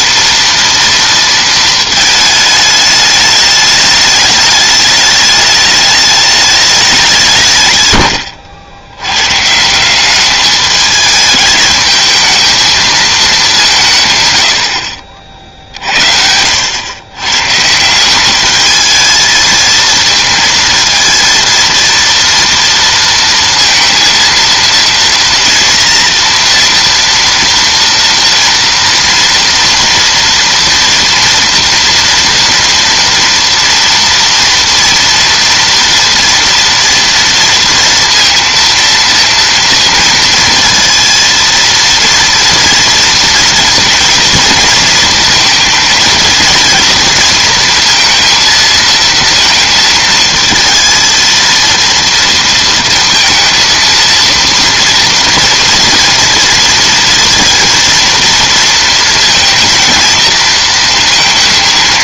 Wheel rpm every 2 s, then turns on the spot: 230, 210, 210, 180, 120, 210, 210, 50, 110, 220, 230, 230, 230, 230, 230, 230, 240, 230, 230, 230, 230, 230, 230, 230, 230, 230, 230, 230, 230, 230, 230.
none